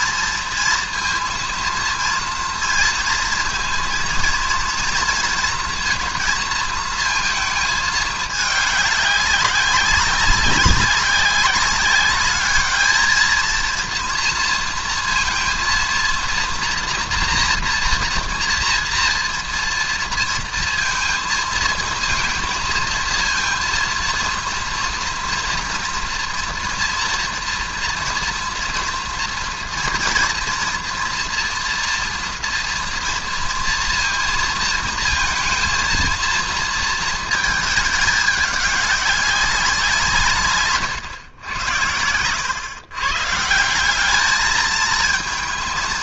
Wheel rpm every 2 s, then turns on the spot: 230, 230, 230, 220, 210, 190, 220, 230, 230, 230, 230, 230, 240, 240, 240, 230, 230, 230, 230, 200, 130, 130, 220.
40-42